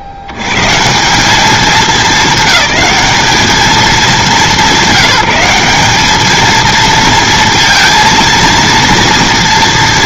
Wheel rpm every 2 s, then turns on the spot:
70, 200, 180, 220, 230.
none